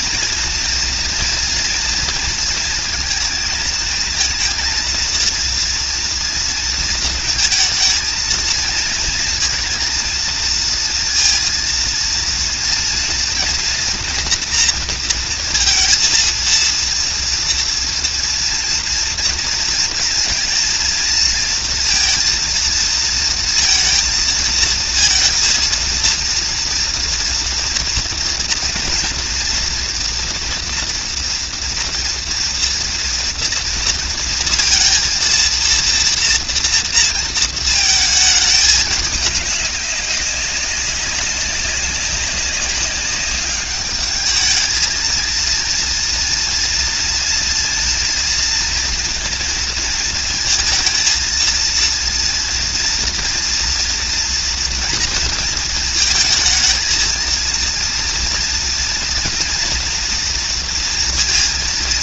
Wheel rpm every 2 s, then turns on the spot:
230, 230, 230, 230, 230, 230, 230, 230, 230, 240, 230, 230, 230, 240, 230, 240, 230, 230, 240, 210, 200, 200, 220, 230, 230, 230, 230, 230, 220, 230, 240.
none